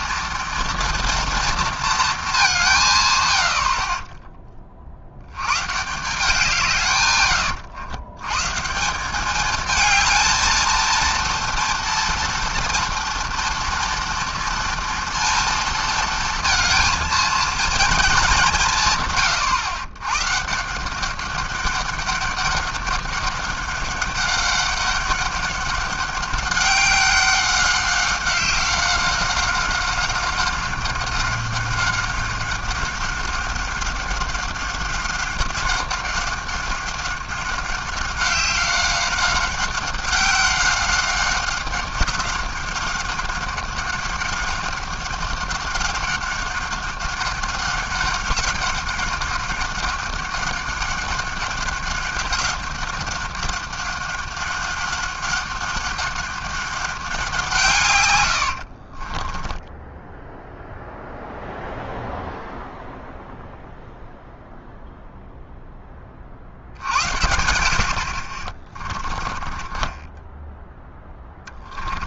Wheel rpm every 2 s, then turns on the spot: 230, 190, 20, 160, 140, 230, 230, 230, 230, 180, 150, 200, 200, 200, 190, 190, 190, 190, 190, 190, 190, 190, 190, 190, 190, 190, 190, 190, 190, 80, 0, 0, 0, 60, 40, 10.
58-60 68-70